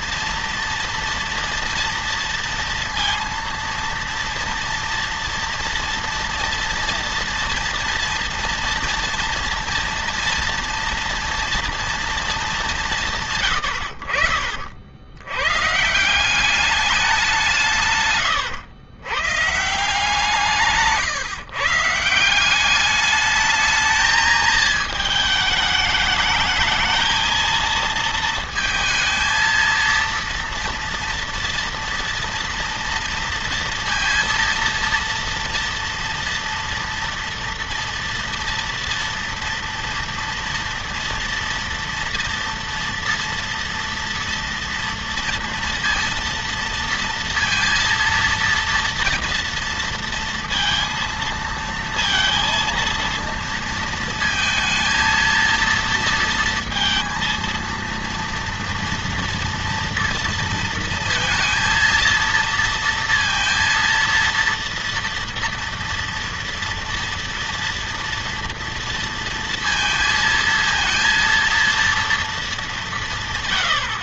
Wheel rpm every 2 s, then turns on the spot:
230, 230, 230, 230, 230, 240, 220, 80, 180, 110, 170, 180, 220, 210, 220, 230, 230, 230, 240, 230, 230, 230, 230, 230, 230, 230, 230, 220, 230, 230, 230, 230, 230, 230, 230, 220, 230.
18-20